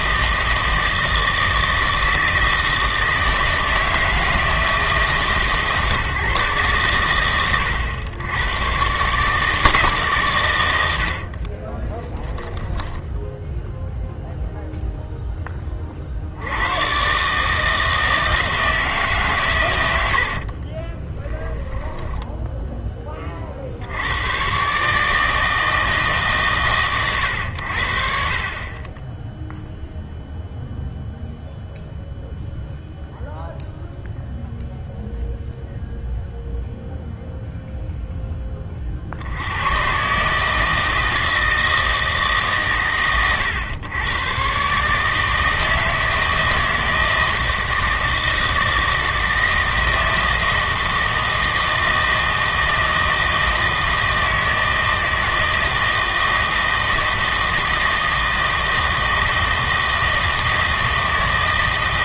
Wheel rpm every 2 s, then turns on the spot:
160, 160, 160, 120, 120, 90, 10, 0, 110, 160, 40, 10, 140, 130, 30, 0, 0, 0, 0, 30, 160, 130, 130, 160, 160, 160, 160, 160, 160, 160, 160.
12-14 20-22